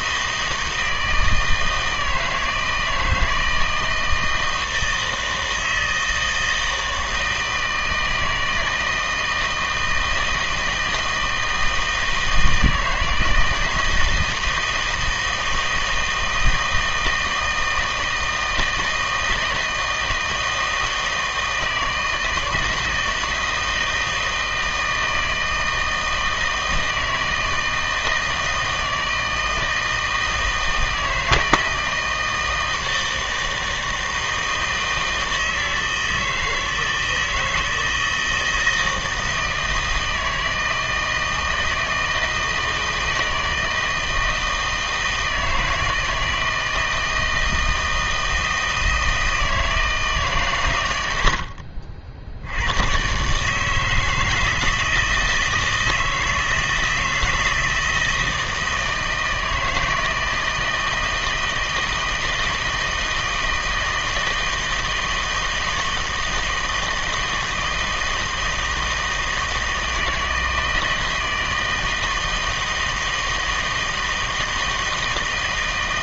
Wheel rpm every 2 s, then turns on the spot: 160, 160, 160, 160, 160, 160, 160, 160, 160, 160, 160, 160, 160, 160, 160, 160, 160, 160, 160, 160, 160, 160, 160, 160, 160, 130, 100, 160, 160, 160, 160, 160, 160, 160, 160, 160, 160, 160.
none